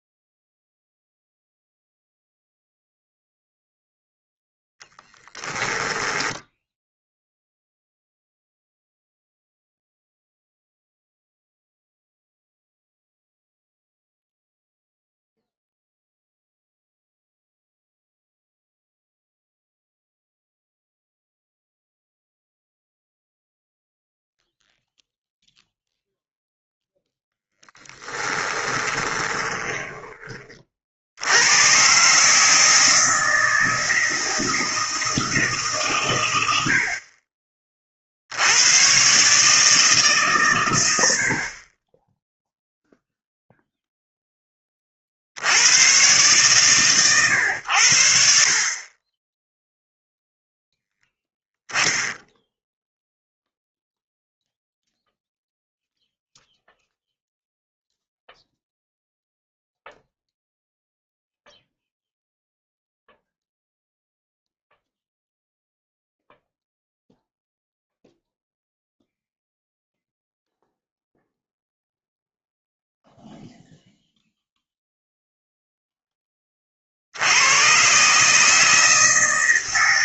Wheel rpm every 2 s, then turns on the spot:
0, 0, 0, 10, 0, 0, 0, 0, 0, 0, 0, 0, 0, 0, 10, 40, 150, 160, 80, 100, 120, 0, 20, 130, 40, 0, 0, 0, 0, 0, 0, 0, 0, 0, 0, 0, 0, 0, 30, 160.
28-30